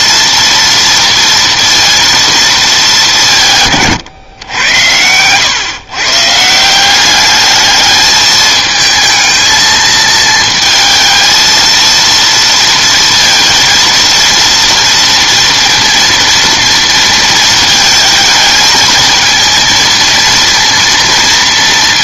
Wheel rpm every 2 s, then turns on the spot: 230, 220, 110, 170, 220, 220, 230, 230, 230, 220, 230.
none